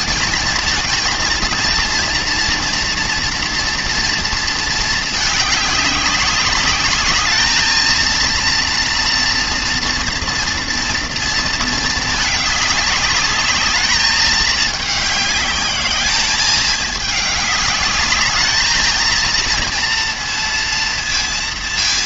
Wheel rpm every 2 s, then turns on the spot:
230, 230, 220, 200, 230, 230, 210, 210, 210, 220, 230.
none